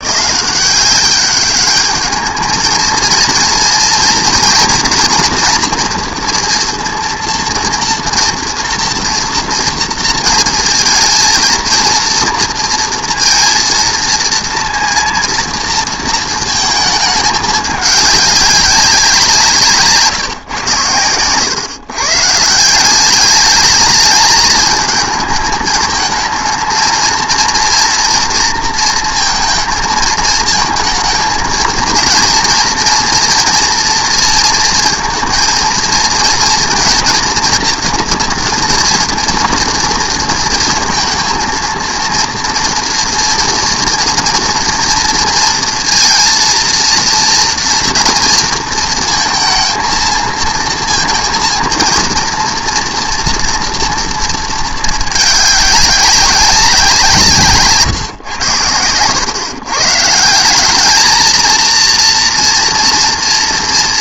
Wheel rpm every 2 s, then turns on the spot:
190, 220, 230, 230, 230, 230, 230, 230, 220, 200, 120, 160, 220, 220, 230, 220, 230, 230, 230, 230, 230, 230, 240, 230, 230, 230, 230, 220, 190, 110, 190, 230.
none